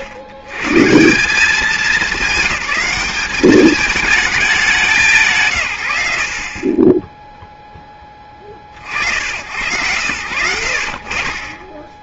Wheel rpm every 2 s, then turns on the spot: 90, 200, 180, 30, 40, 80.
6-8